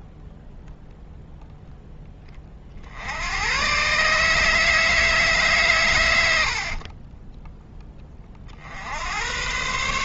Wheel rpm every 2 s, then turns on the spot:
0, 50, 160, 50, 70.
6-8